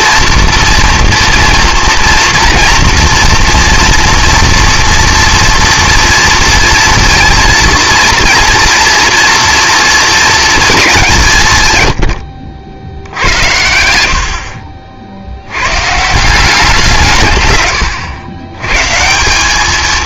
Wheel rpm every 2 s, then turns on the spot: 230, 230, 230, 230, 230, 210, 70, 40, 190, 130.
none